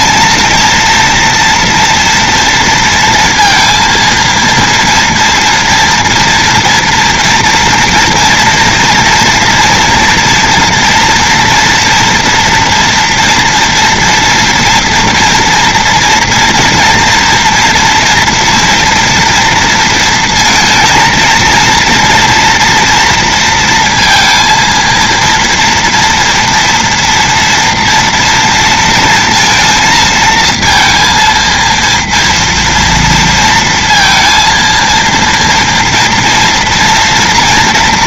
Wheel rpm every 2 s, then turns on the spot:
230, 230, 230, 230, 230, 230, 230, 240, 230, 240, 230, 230, 230, 240, 230, 230, 230, 230, 230.
none